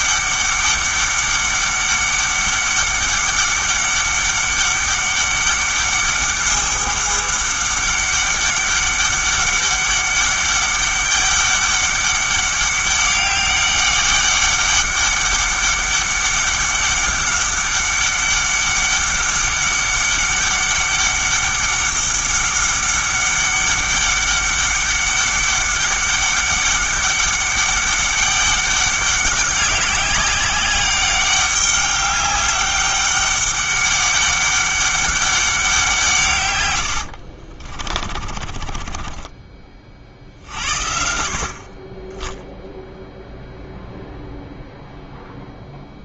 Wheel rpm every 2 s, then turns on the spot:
200, 200, 200, 200, 200, 200, 200, 200, 200, 200, 200, 200, 200, 200, 200, 200, 200, 200, 110, 30, 60, 0, 0.
38-40